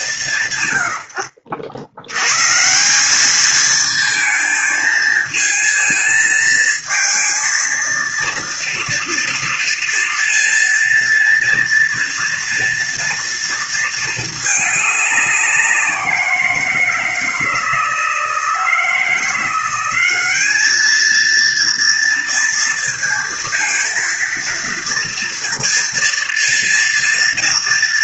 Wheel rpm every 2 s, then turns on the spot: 140, 120, 230, 230, 230, 230, 230, 220, 170, 160, 200, 230, 230, 230.
none